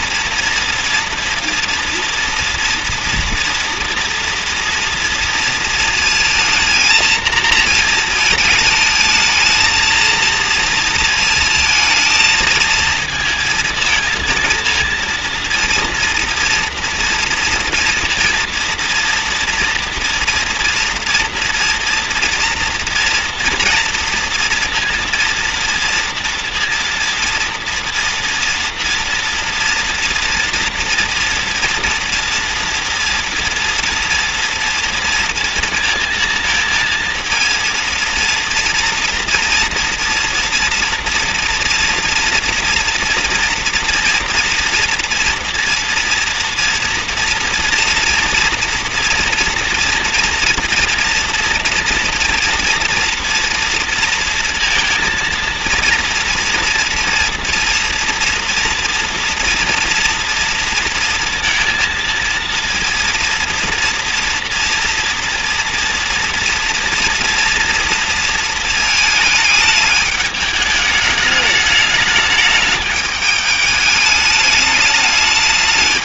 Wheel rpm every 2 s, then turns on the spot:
230, 240, 230, 230, 220, 230, 220, 230, 230, 230, 230, 230, 230, 230, 230, 230, 230, 230, 230, 230, 230, 240, 240, 240, 230, 230, 230, 230, 230, 230, 230, 230, 230, 240, 230, 210, 210, 210.
none